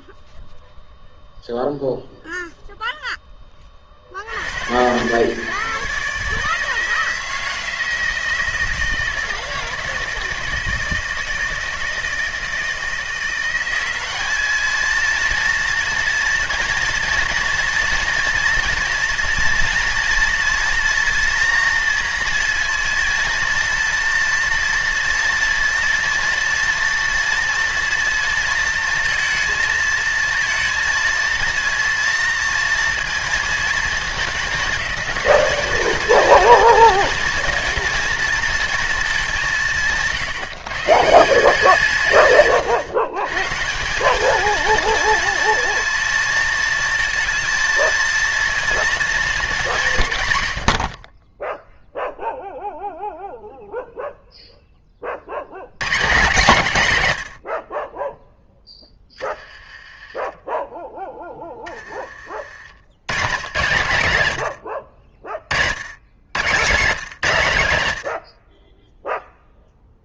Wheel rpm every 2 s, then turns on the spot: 0, 0, 120, 160, 160, 160, 170, 220, 230, 240, 230, 230, 230, 230, 230, 230, 230, 210, 230, 220, 150, 120, 230, 220, 230, 60, 0, 0, 170, 10, 10, 100, 70, 180, 10.
none